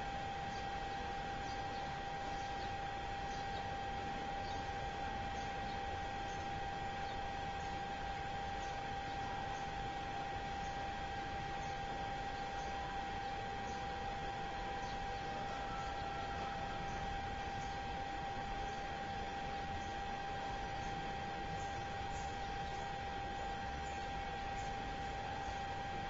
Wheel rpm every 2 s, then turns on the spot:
0, 0, 0, 0, 0, 0, 0, 0, 0, 0, 0, 0, 0.
none